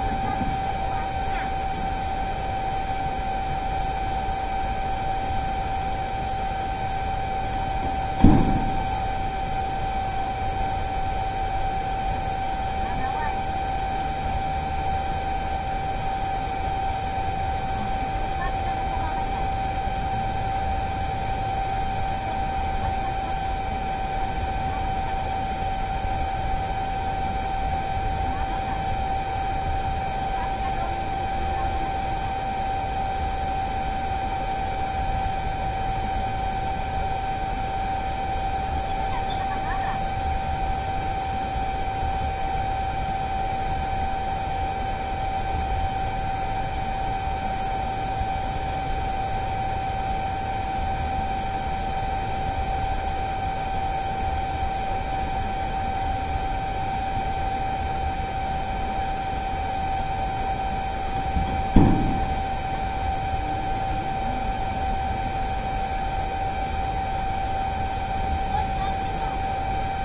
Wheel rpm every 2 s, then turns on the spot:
0, 0, 0, 0, 0, 0, 0, 0, 0, 0, 0, 0, 0, 0, 0, 0, 0, 0, 0, 0, 0, 0, 0, 0, 0, 0, 0, 0, 0, 0, 0, 0, 0, 0, 0.
none